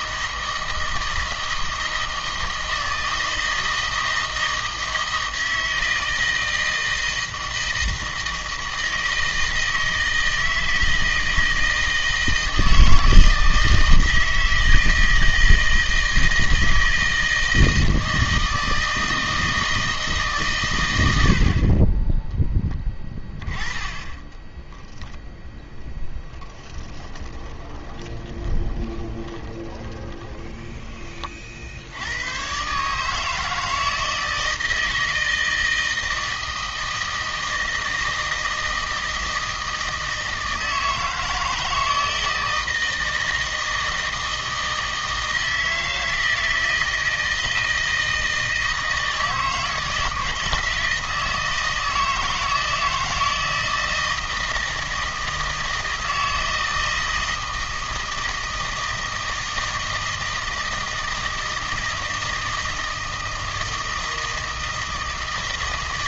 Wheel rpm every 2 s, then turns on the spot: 160, 160, 160, 160, 160, 160, 160, 160, 160, 160, 130, 10, 10, 10, 20, 20, 130, 160, 160, 160, 160, 160, 160, 160, 160, 160, 160, 160, 160, 160, 160, 160, 160.
24-32